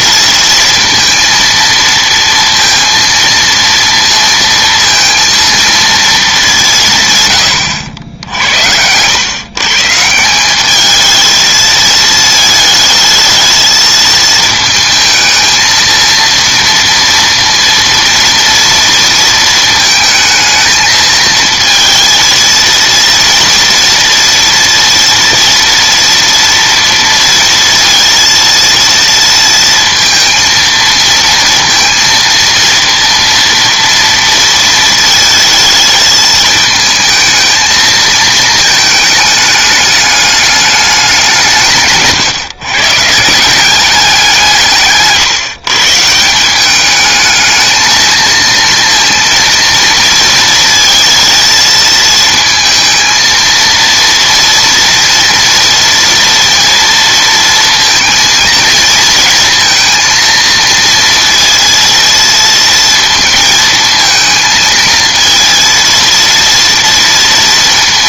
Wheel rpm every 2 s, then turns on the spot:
230, 230, 230, 180, 80, 200, 220, 220, 230, 230, 220, 230, 230, 230, 230, 230, 230, 230, 220, 220, 210, 130, 160, 190, 230, 220, 220, 230, 230, 230, 230, 230, 230, 230.
none